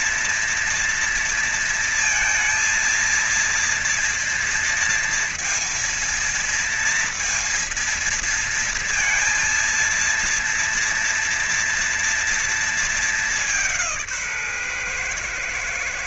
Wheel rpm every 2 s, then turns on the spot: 230, 230, 230, 230, 230, 230, 230, 160.
none